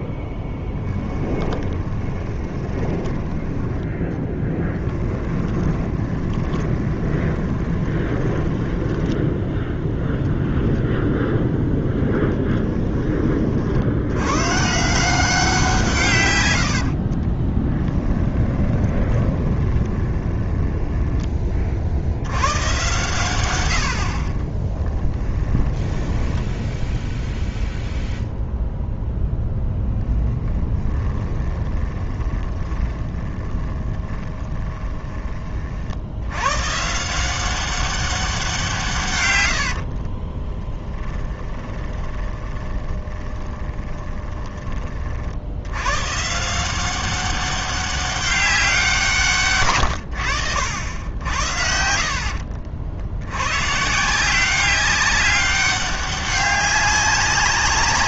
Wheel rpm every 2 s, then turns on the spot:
0, 20, 10, 20, 20, 0, 10, 150, 70, 20, 10, 120, 20, 0, 0, 10, 20, 20, 140, 170, 20, 20, 20, 180, 180, 80, 60, 190, 200.
2-10 16-22 24-26 30-36 40-44 50-52